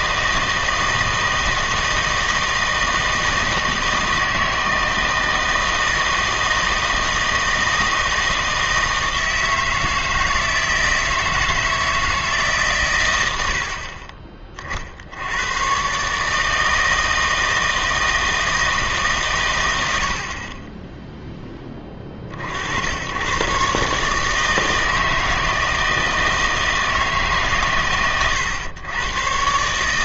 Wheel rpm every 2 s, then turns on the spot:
160, 160, 160, 160, 160, 160, 130, 70, 160, 150, 10, 90, 160, 160, 120.
none